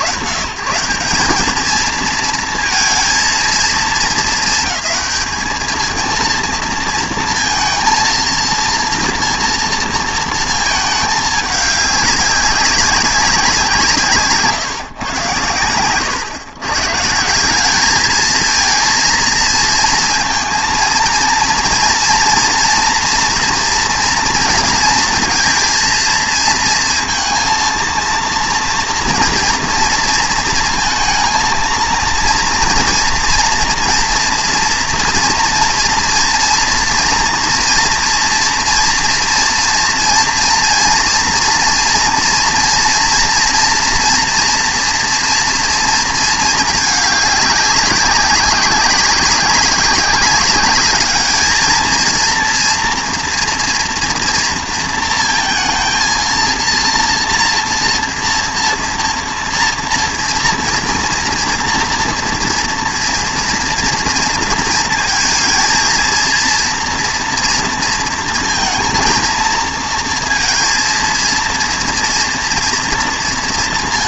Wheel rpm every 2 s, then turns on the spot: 120, 230, 210, 230, 230, 220, 200, 140, 140, 230, 230, 230, 230, 230, 230, 230, 230, 230, 230, 230, 230, 240, 230, 210, 190, 210, 230, 230, 230, 230, 230, 240, 230, 230, 230, 230, 230.
none